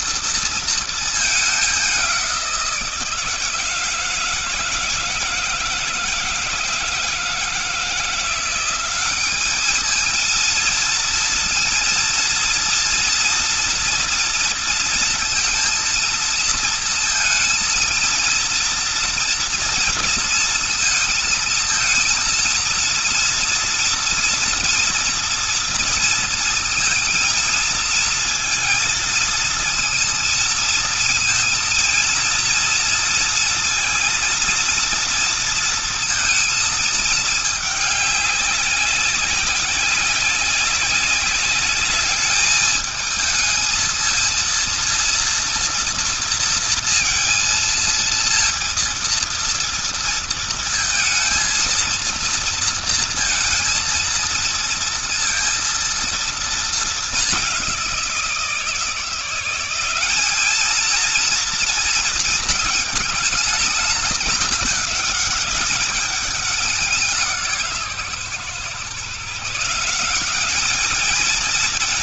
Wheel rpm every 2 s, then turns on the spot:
220, 170, 160, 160, 190, 230, 230, 230, 230, 230, 220, 230, 230, 230, 230, 230, 230, 230, 220, 190, 190, 210, 230, 230, 230, 220, 230, 230, 220, 170, 220, 210, 200, 180, 140, 210.
none